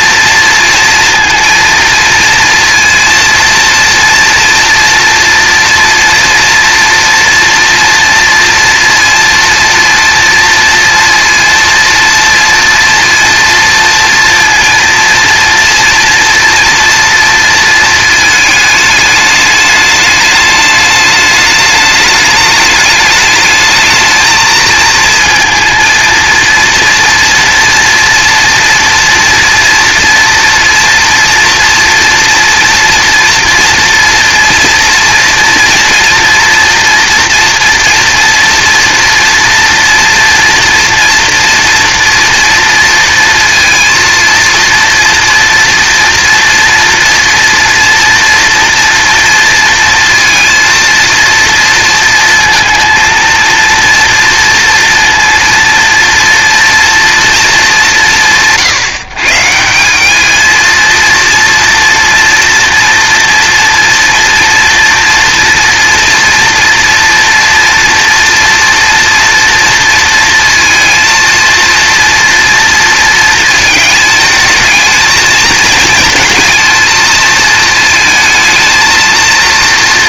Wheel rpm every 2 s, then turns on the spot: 230, 230, 230, 230, 230, 230, 230, 230, 230, 210, 210, 210, 220, 230, 230, 240, 230, 240, 230, 230, 230, 230, 230, 230, 230, 230, 230, 230, 230, 130, 230, 230, 230, 230, 230, 230, 230, 220, 230, 230.
none